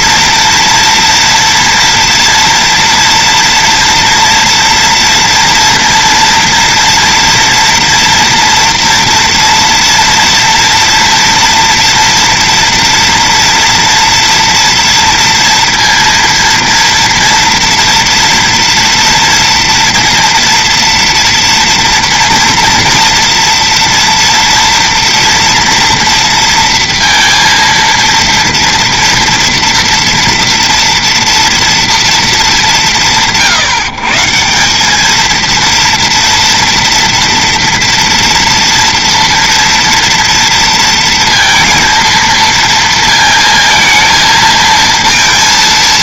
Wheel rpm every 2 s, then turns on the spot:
240, 230, 230, 230, 230, 230, 230, 230, 230, 240, 230, 230, 230, 230, 230, 230, 240, 150, 230, 230, 230, 230, 220.
none